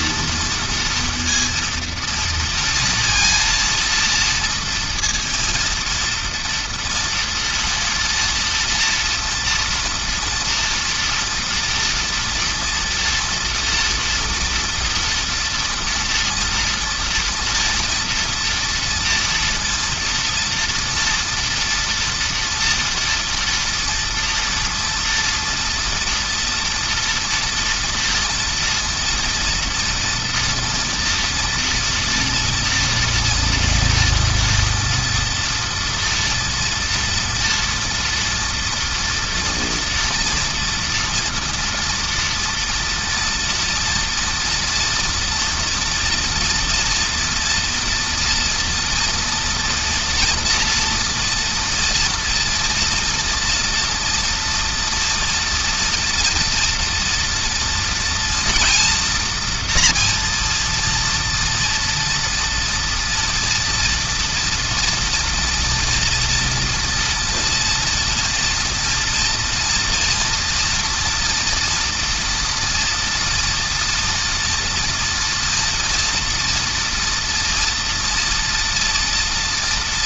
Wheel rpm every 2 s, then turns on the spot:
230, 230, 230, 230, 230, 230, 230, 230, 230, 240, 230, 230, 230, 230, 230, 230, 230, 230, 240, 230, 230, 230, 230, 230, 230, 230, 230, 240, 240, 240, 230, 230, 230, 230, 230, 230, 230, 230, 240, 230.
none